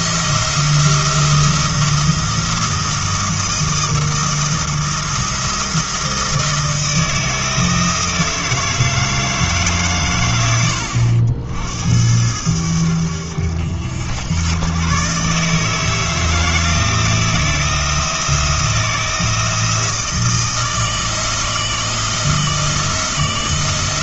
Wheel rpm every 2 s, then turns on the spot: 170, 170, 170, 160, 160, 90, 80, 120, 170, 170, 160, 160.
none